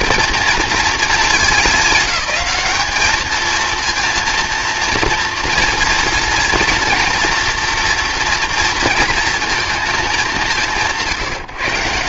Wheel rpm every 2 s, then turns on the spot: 220, 210, 230, 230, 230, 180.
none